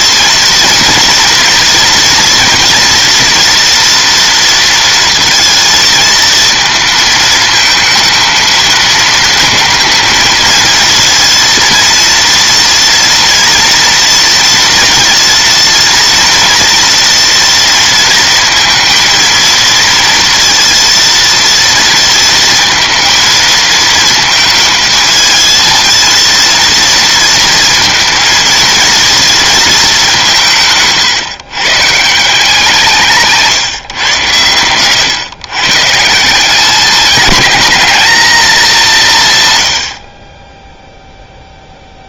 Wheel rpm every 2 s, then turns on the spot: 230, 240, 230, 230, 220, 230, 230, 230, 230, 230, 230, 230, 220, 230, 220, 150, 170, 110, 180, 210, 10.
34-36